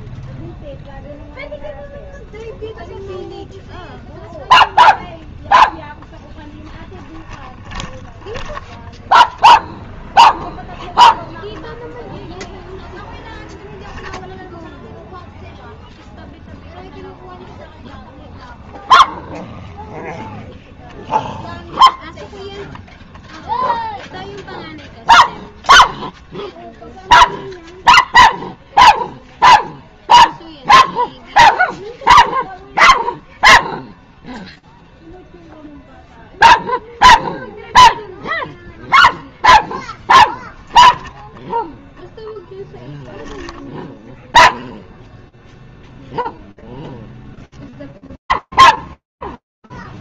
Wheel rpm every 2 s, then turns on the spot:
0, 0, 0, 30, 0, 0, 0, 0, 0, 0, 0, 0, 0, 0, 0, 0, 0, 0, 0, 0, 10, 10, 0, 0, 0.
6-8